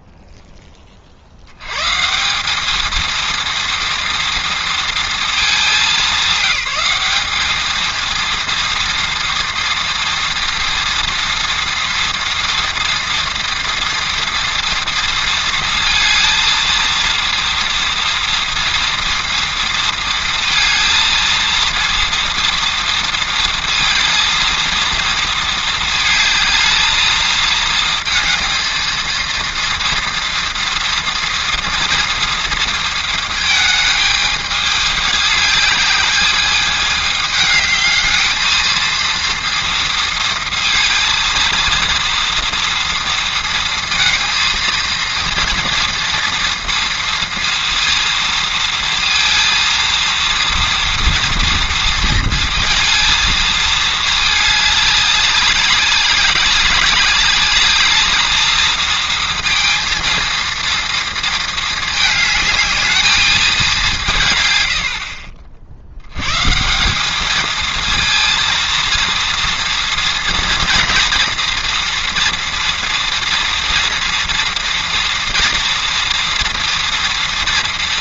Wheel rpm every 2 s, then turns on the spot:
30, 220, 230, 210, 230, 230, 230, 230, 230, 230, 220, 230, 230, 220, 230, 230, 230, 210, 210, 230, 230, 230, 230, 230, 230, 230, 230, 200, 200, 220, 230, 220, 80, 190, 230, 240, 230, 240, 230.
none